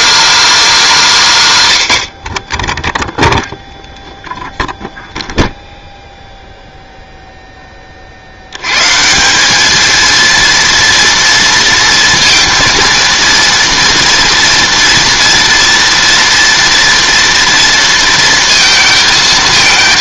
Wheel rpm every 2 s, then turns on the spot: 280, 20, 0, 0, 110, 230, 230, 230, 230, 230.
none